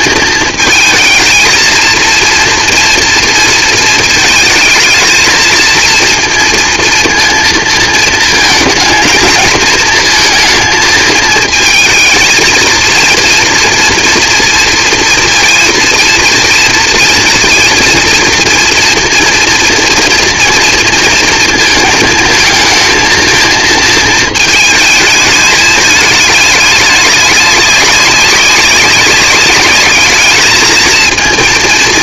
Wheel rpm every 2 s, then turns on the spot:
230, 230, 220, 230, 230, 230, 220, 230, 230, 230, 230, 220, 220, 210, 200, 220.
none